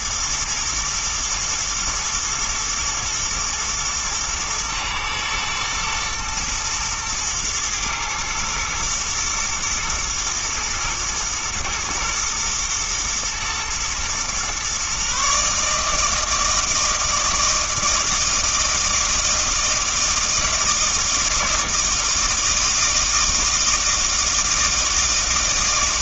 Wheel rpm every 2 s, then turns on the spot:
120, 110, 120, 120, 110, 110, 120, 130, 160, 160, 160, 160, 160.
none